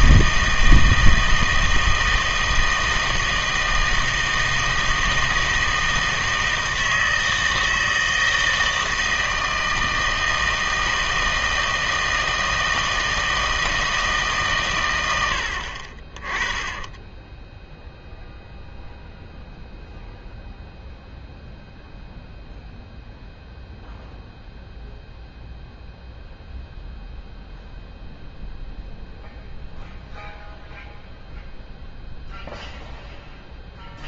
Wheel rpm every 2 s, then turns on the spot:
160, 160, 160, 160, 160, 160, 160, 120, 10, 0, 0, 0, 0, 0, 0, 0, 0.
16-18